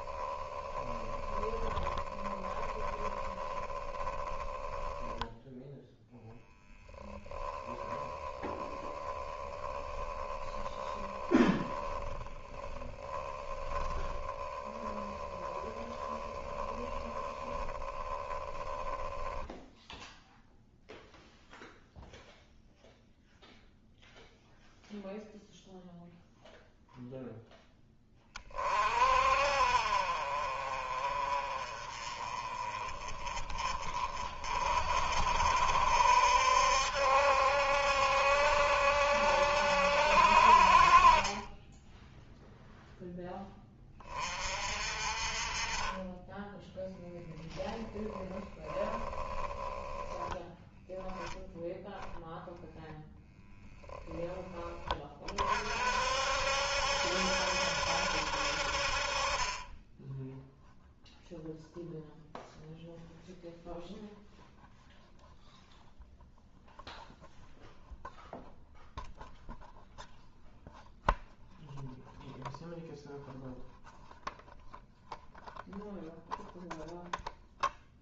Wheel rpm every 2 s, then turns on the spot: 10, 10, 10, 0, 30, 10, 10, 10, 10, 10, 0, 0, 0, 0, 30, 40, 30, 50, 70, 70, 50, 0, 40, 10, 20, 0, 0, 10, 60, 60, 10, 0, 0, 0, 0, 0, 0, 0, 0.
0-6 8-20 48-50